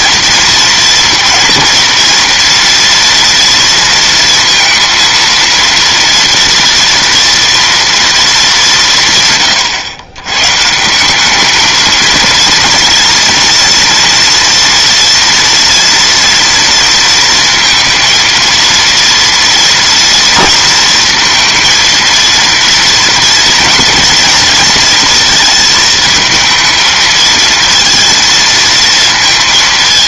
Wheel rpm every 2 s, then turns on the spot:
230, 230, 230, 230, 180, 160, 230, 230, 230, 230, 230, 240, 230, 220, 230.
none